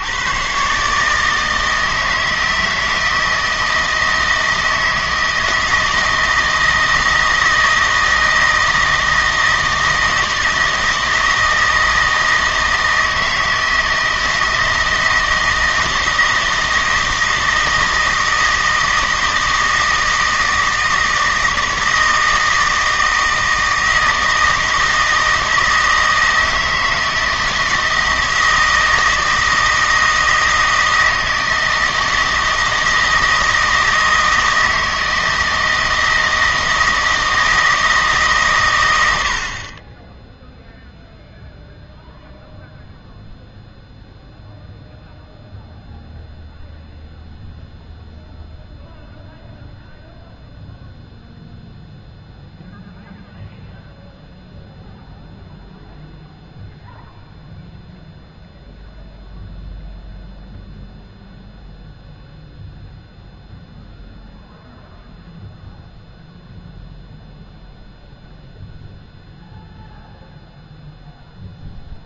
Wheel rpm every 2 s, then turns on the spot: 140, 160, 160, 160, 160, 160, 160, 160, 160, 160, 160, 160, 160, 160, 160, 160, 160, 160, 160, 110, 0, 0, 0, 0, 0, 0, 0, 0, 0, 0, 0, 0, 0, 0, 0, 0.
none